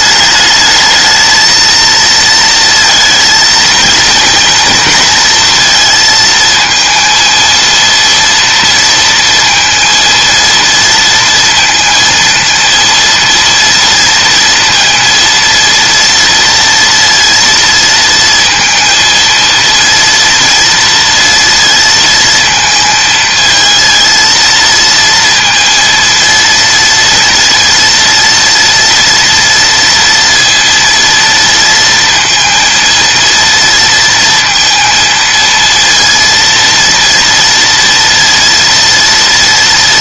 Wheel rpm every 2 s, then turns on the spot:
220, 230, 240, 230, 230, 230, 230, 230, 230, 230, 230, 220, 230, 230, 230, 230, 230, 230, 230, 230.
none